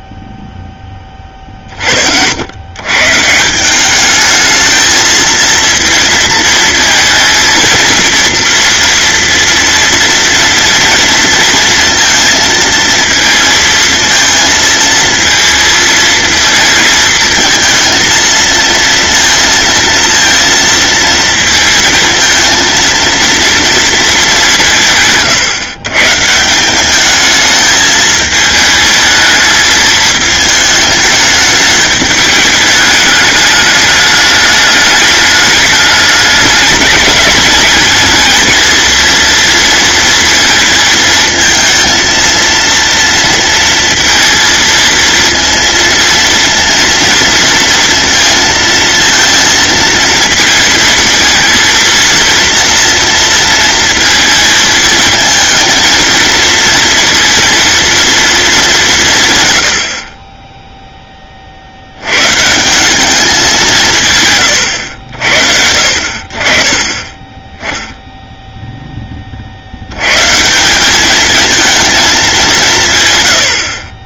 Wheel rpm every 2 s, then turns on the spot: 10, 110, 220, 230, 230, 230, 230, 230, 220, 230, 230, 230, 160, 200, 220, 210, 210, 210, 210, 230, 230, 230, 230, 230, 230, 220, 230, 230, 230, 210, 10, 190, 90, 30, 10, 190, 220.
none